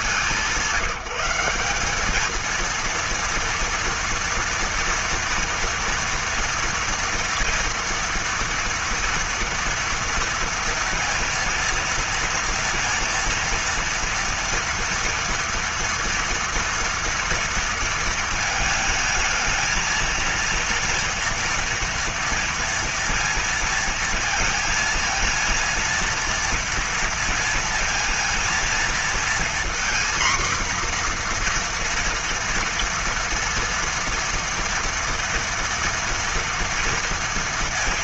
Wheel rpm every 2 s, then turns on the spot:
190, 230, 230, 230, 230, 230, 230, 230, 230, 220, 230, 230, 230, 230, 230, 250, 240, 230, 230.
none